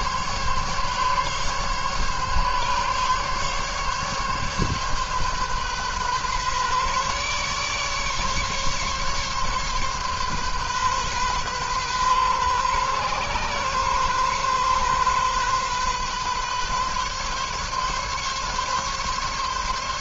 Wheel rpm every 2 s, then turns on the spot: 140, 140, 140, 140, 140, 130, 130, 130, 140, 140.
none